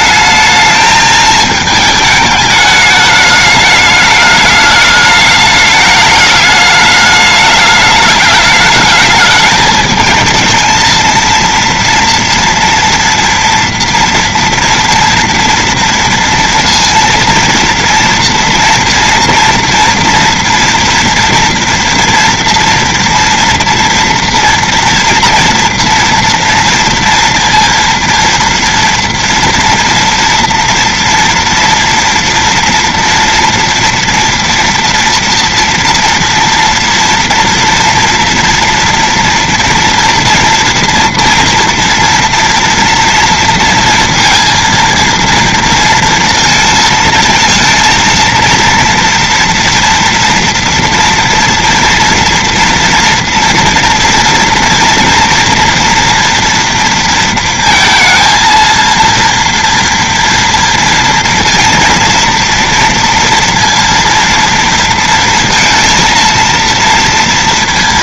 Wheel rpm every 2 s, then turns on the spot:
210, 220, 210, 210, 210, 210, 230, 230, 230, 230, 230, 230, 230, 230, 230, 230, 230, 240, 230, 230, 240, 230, 230, 230, 230, 240, 240, 240, 240, 230, 230, 230, 230, 230.
none